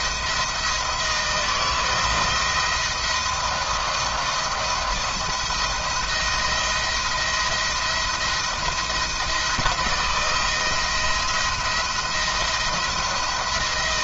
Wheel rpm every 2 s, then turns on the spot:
160, 170, 170, 170, 170, 160, 170.
none